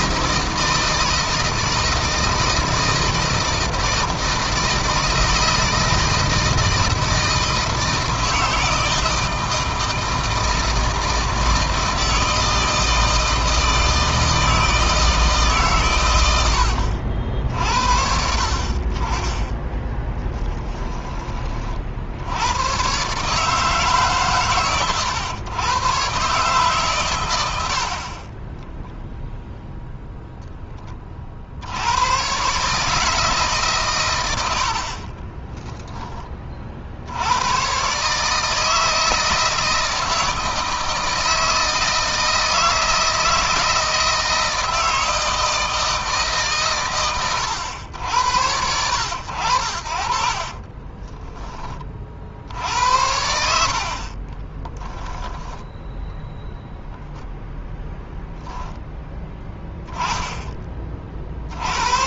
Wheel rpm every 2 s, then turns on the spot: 160, 160, 160, 160, 160, 160, 160, 160, 80, 40, 20, 120, 110, 130, 10, 20, 140, 60, 50, 160, 160, 160, 160, 130, 90, 30, 70, 10, 0, 0, 30.
28-30 50-52 54-56